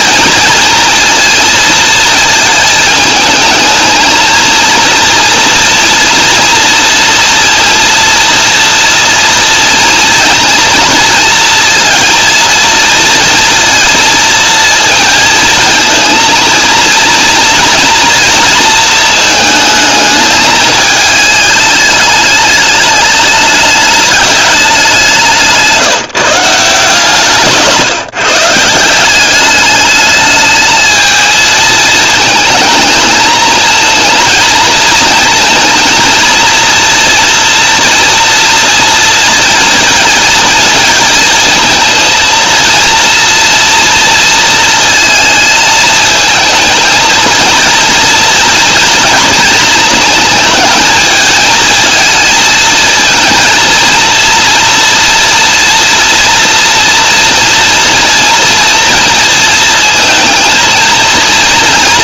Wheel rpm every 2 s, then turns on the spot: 230, 220, 230, 230, 230, 230, 230, 230, 230, 230, 220, 210, 200, 160, 170, 220, 220, 220, 230, 230, 230, 230, 230, 230, 230, 220, 220, 240, 230, 230, 220.
none